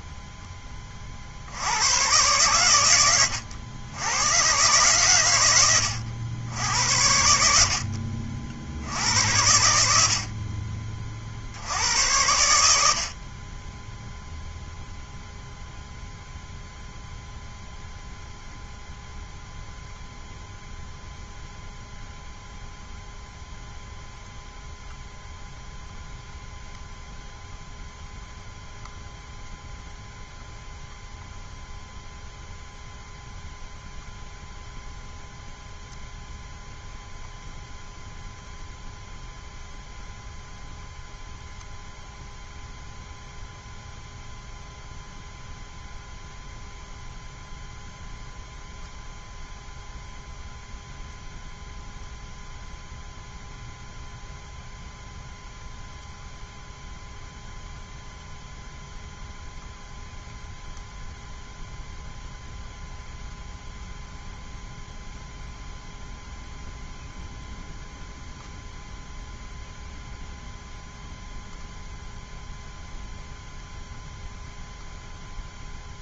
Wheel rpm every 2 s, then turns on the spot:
10, 120, 120, 90, 60, 50, 90, 0, 0, 0, 0, 0, 0, 0, 0, 0, 0, 0, 0, 0, 0, 0, 0, 0, 0, 0, 0, 0, 0, 0, 0, 0, 0, 0, 0, 0, 0, 0.
none